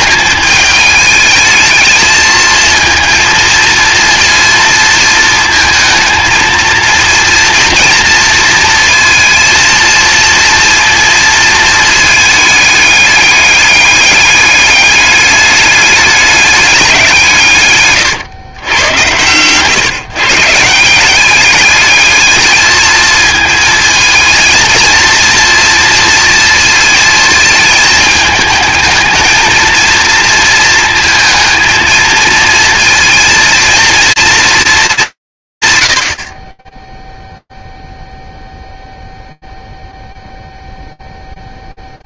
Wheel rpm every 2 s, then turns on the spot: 220, 230, 230, 230, 230, 230, 210, 210, 190, 110, 170, 220, 230, 230, 220, 220, 230, 210, 0, 0, 0.
none